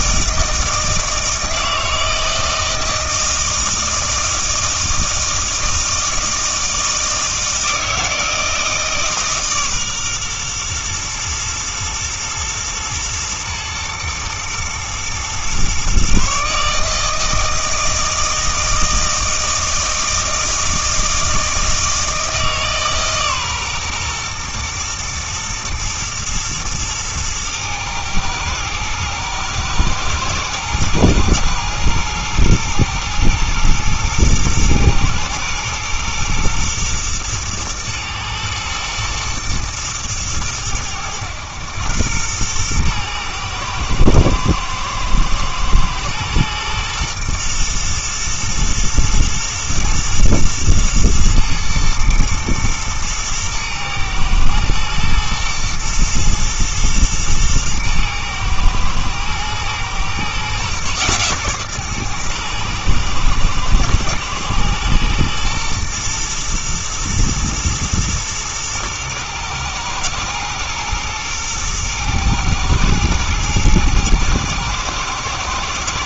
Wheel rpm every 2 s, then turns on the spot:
160, 160, 160, 160, 160, 120, 110, 120, 150, 160, 160, 150, 120, 110, 110, 120, 110, 120, 120, 110, 100, 110, 110, 120, 110, 110, 120, 110, 120, 110, 130, 110, 110, 110, 110, 110, 110, 120.
none